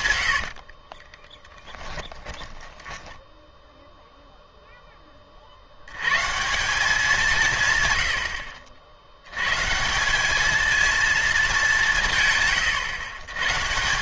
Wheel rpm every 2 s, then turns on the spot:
40, 10, 10, 180, 70, 220, 120.
0-4